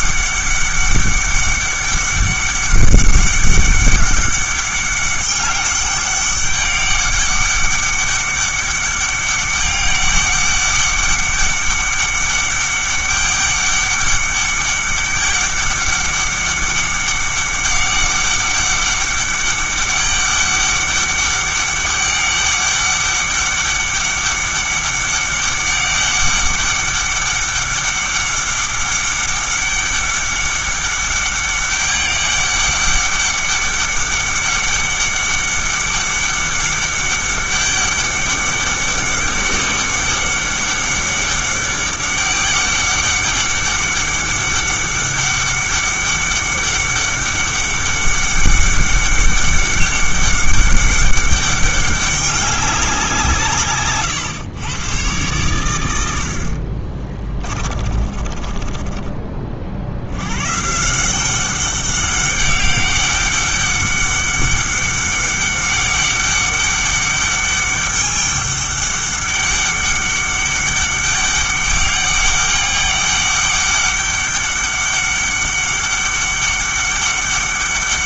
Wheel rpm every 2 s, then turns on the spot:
200, 200, 200, 200, 200, 200, 200, 200, 200, 200, 200, 200, 200, 200, 200, 200, 200, 200, 200, 200, 200, 200, 200, 200, 200, 200, 190, 120, 50, 30, 140, 200, 200, 200, 200, 200, 200, 200, 200.
56-60